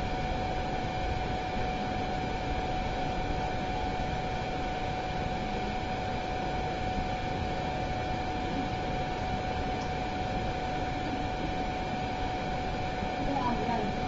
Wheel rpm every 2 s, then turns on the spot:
0, 0, 0, 0, 0, 0, 0.
none